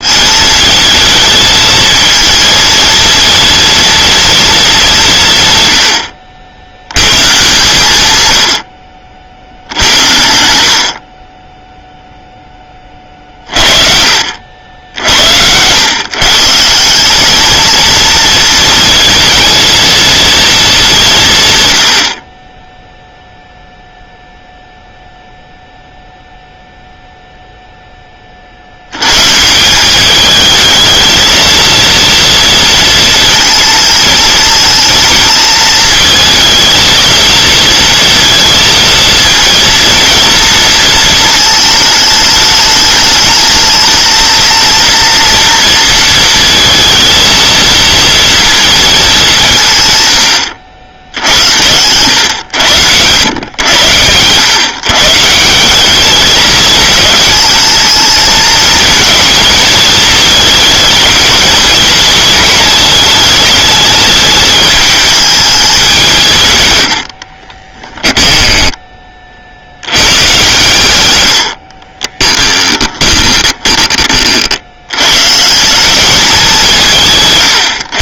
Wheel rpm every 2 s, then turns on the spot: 220, 230, 190, 100, 60, 50, 30, 70, 190, 230, 200, 0, 0, 0, 100, 220, 230, 220, 230, 220, 230, 210, 230, 230, 210, 80, 90, 140, 220, 220, 210, 210, 210, 80, 20, 110, 20, 100, 160.
66-68 72-74